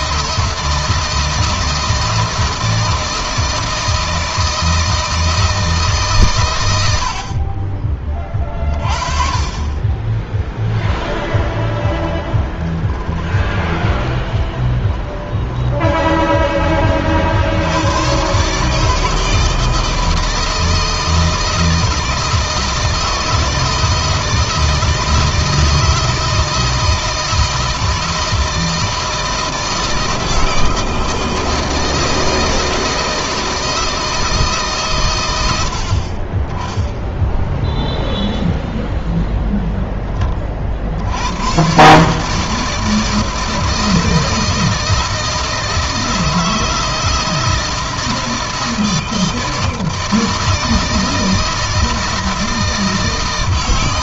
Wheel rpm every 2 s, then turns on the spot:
160, 160, 160, 80, 30, 10, 20, 10, 30, 140, 160, 160, 160, 160, 160, 160, 160, 140, 20, 0, 50, 160, 160, 160, 160, 160, 160.
10-16